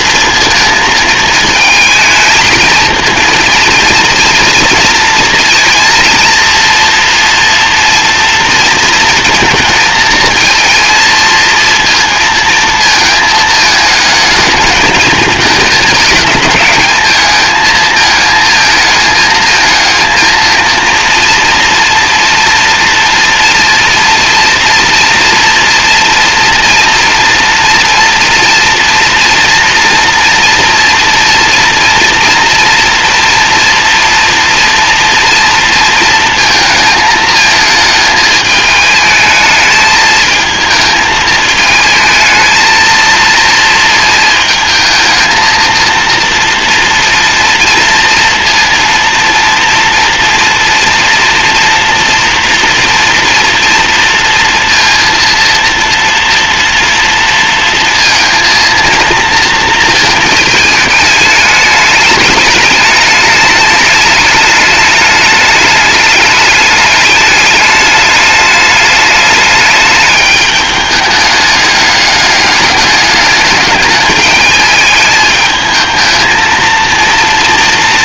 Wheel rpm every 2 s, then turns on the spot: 220, 230, 230, 230, 230, 230, 230, 220, 220, 220, 230, 230, 230, 230, 230, 240, 230, 230, 220, 220, 220, 220, 220, 240, 230, 230, 240, 230, 230, 230, 210, 210, 210, 200, 210, 210, 200, 210, 230.
none